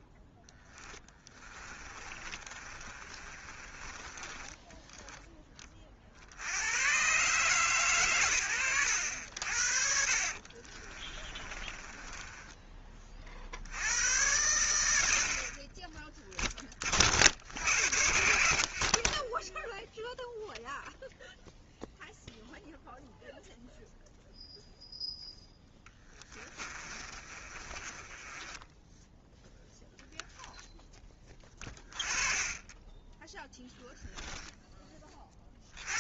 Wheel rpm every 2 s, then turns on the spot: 10, 30, 10, 80, 70, 40, 20, 80, 30, 60, 0, 0, 0, 20, 10, 10, 20, 10.
0-6 10-12 26-28